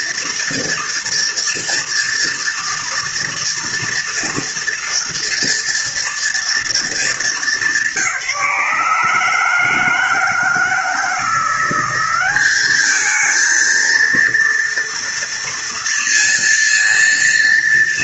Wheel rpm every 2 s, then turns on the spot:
240, 230, 230, 230, 160, 160, 200, 230, 230.
none